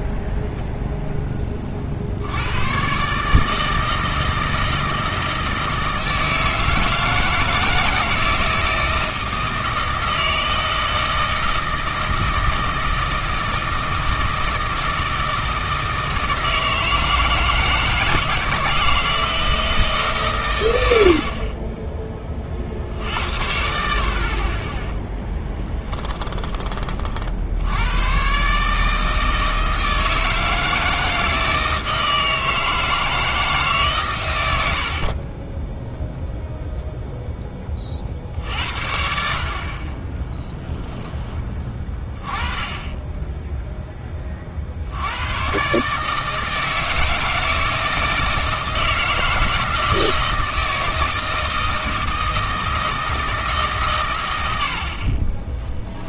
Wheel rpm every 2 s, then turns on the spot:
0, 120, 160, 160, 160, 160, 160, 160, 160, 160, 100, 50, 20, 30, 150, 160, 160, 70, 0, 70, 0, 20, 60, 160, 160, 160, 160, 50.
none